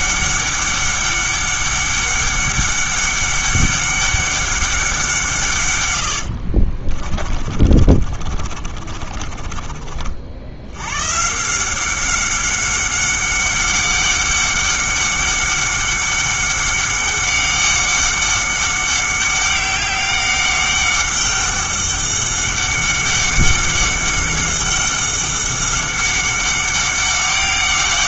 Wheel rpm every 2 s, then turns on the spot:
200, 200, 190, 50, 30, 90, 190, 200, 190, 190, 200, 200, 190, 200.
6-10